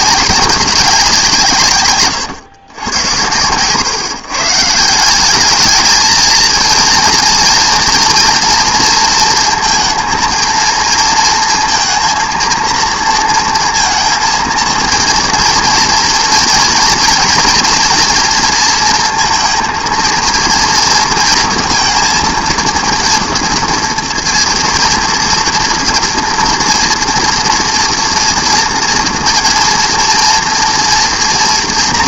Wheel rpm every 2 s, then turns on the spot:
190, 110, 150, 230, 230, 230, 230, 230, 230, 230, 230, 230, 230, 230, 230, 240.
none